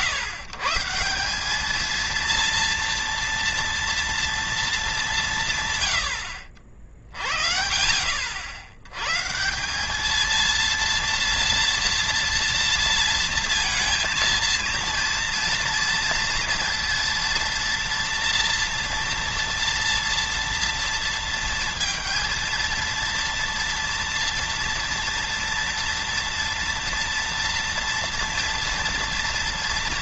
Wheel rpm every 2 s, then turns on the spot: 160, 230, 210, 50, 100, 230, 230, 230, 230, 230, 230, 230, 230, 230, 240.
none